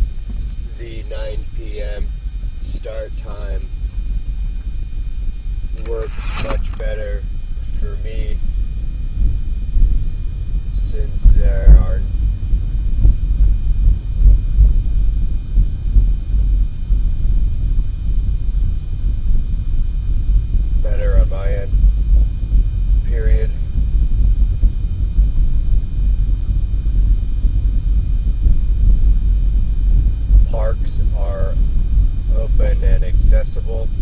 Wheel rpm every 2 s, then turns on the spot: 0, 0, 0, 0, 0, 0, 0, 0, 0, 0, 0, 0, 0, 0, 0, 0, 0.
none